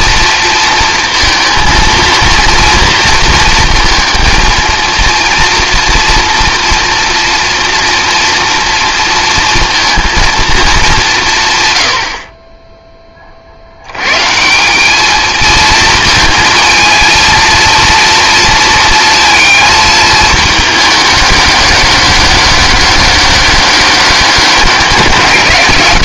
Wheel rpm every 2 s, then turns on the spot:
230, 230, 230, 230, 230, 220, 20, 190, 230, 230, 210, 200, 190.
none